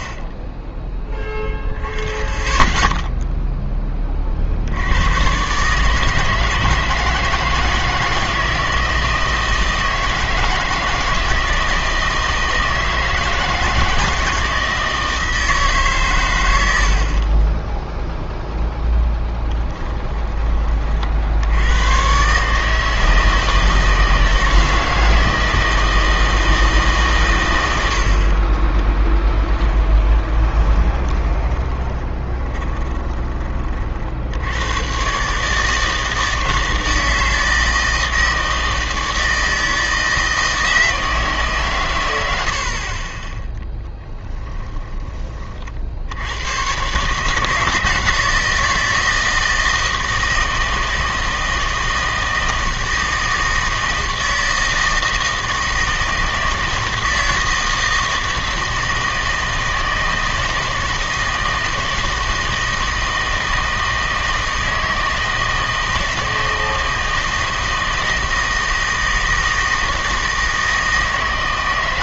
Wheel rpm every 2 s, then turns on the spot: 10, 10, 70, 160, 160, 160, 160, 160, 90, 10, 30, 150, 160, 160, 20, 20, 20, 110, 160, 160, 160, 50, 10, 110, 160, 160, 160, 160, 160, 160, 160, 160, 160, 160, 160, 160.
18-20 30-34 42-46